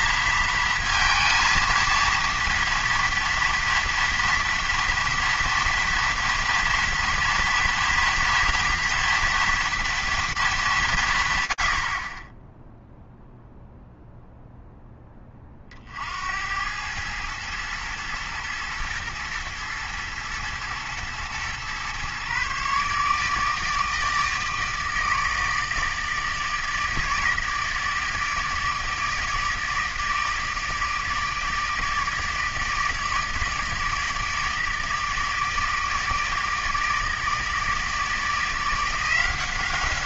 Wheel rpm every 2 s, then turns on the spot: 230, 240, 230, 230, 230, 200, 0, 0, 90, 120, 110, 140, 160, 160, 160, 160, 160, 160, 160, 170.
none